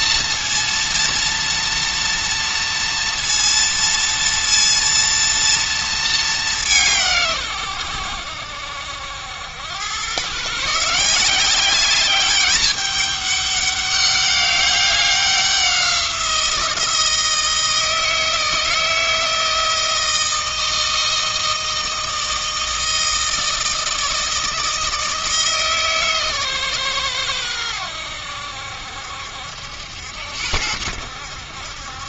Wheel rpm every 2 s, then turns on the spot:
240, 230, 230, 120, 80, 180, 200, 190, 160, 160, 160, 160, 160, 110, 70, 80.
none